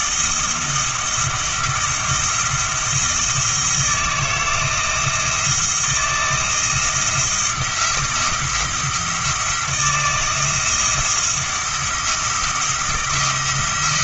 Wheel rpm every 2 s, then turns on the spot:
170, 170, 160, 170, 170, 170, 170.
none